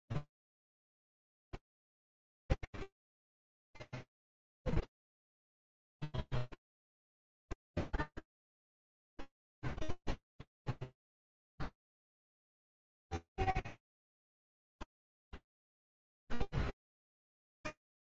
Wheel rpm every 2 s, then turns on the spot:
50, 0, 0, 10, 0, 0, 10, 10, 40.
12-14